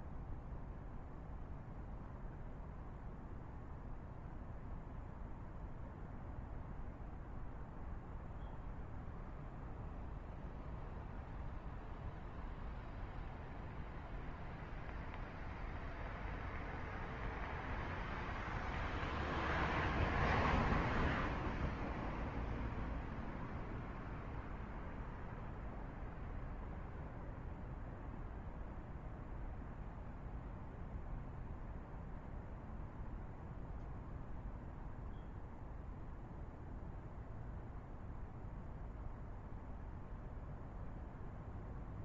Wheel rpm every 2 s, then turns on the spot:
0, 0, 0, 0, 0, 0, 0, 0, 0, 0, 0, 0, 0, 0, 0, 0, 0, 0, 0, 0, 0.
none